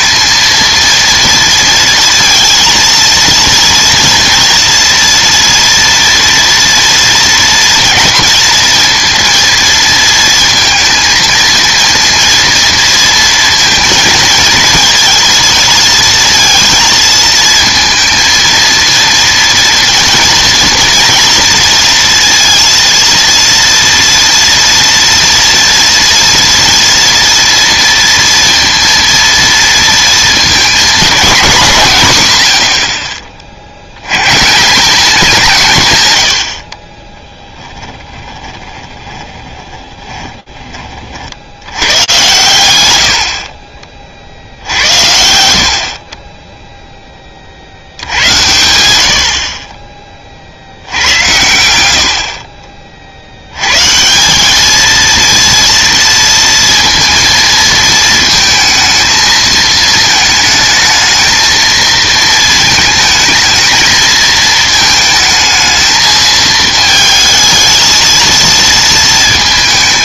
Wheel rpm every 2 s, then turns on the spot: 230, 230, 230, 230, 230, 230, 230, 220, 230, 230, 230, 230, 230, 230, 230, 230, 70, 160, 50, 10, 30, 100, 90, 10, 80, 90, 50, 230, 230, 220, 220, 220, 220, 220, 230.
38-40